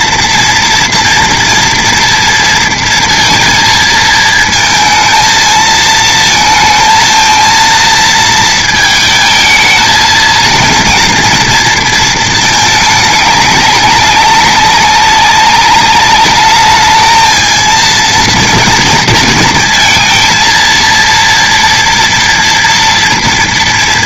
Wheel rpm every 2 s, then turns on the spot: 230, 230, 220, 230, 230, 240, 210, 190, 210, 230, 230, 230.
none